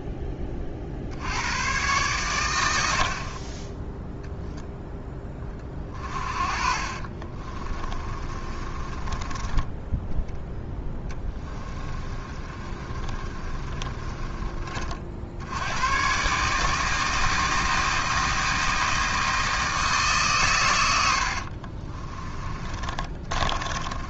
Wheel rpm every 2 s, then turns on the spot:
40, 80, 10, 40, 20, 10, 30, 50, 160, 160, 100, 30.
6-14 22-24